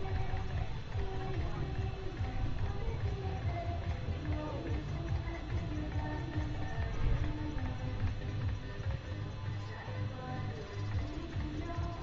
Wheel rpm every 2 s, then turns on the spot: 0, 0, 0, 0, 0, 0.
none